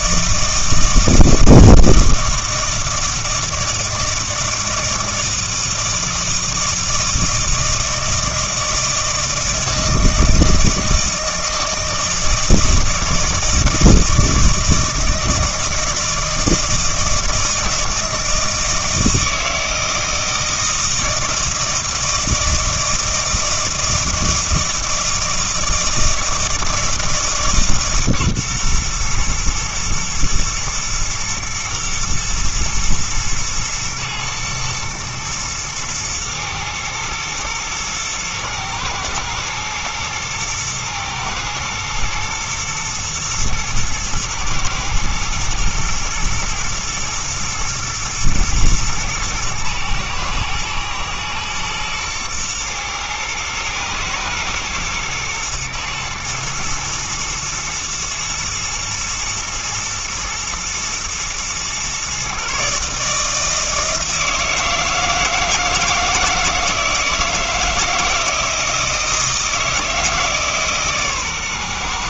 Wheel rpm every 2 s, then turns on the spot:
160, 160, 160, 160, 160, 160, 160, 160, 160, 160, 160, 160, 160, 160, 120, 120, 120, 110, 110, 120, 120, 110, 110, 120, 110, 110, 110, 120, 110, 120, 110, 140, 160, 160, 160, 150.
none